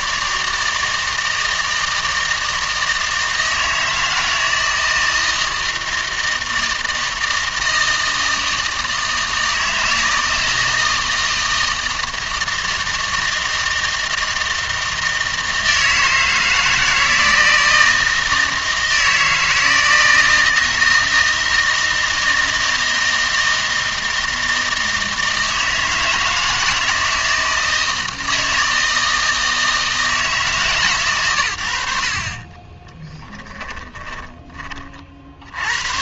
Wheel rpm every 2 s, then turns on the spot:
160, 160, 160, 160, 160, 160, 160, 160, 160, 160, 160, 160, 160, 160, 160, 150, 40, 20.
32-34